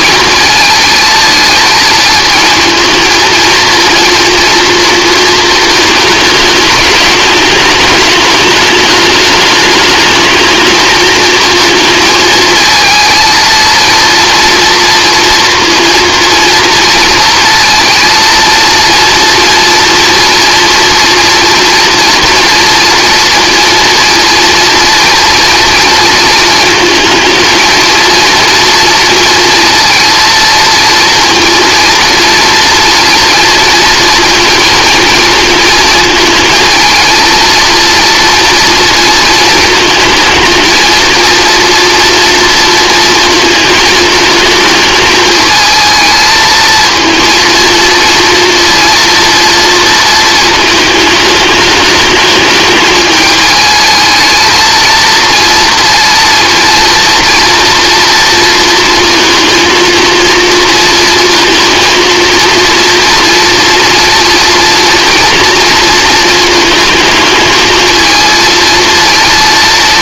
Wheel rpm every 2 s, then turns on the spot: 220, 230, 230, 210, 210, 220, 220, 230, 230, 230, 230, 230, 230, 220, 230, 230, 230, 230, 220, 230, 220, 230, 220, 220, 230, 220, 210, 230, 230, 230, 230, 230, 240, 220, 230.
none